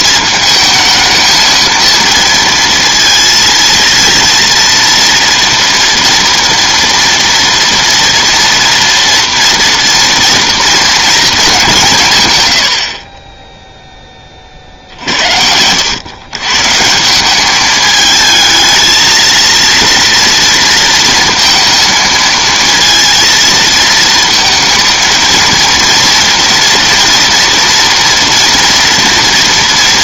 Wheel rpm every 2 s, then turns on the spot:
220, 230, 230, 230, 230, 230, 40, 60, 160, 220, 230, 220, 230, 230, 230.
12-14